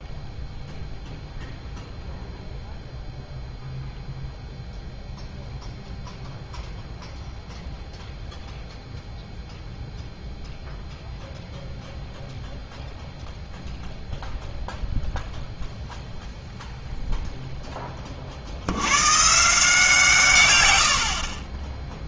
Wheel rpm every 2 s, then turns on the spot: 0, 0, 0, 0, 0, 0, 0, 0, 0, 90, 90.
none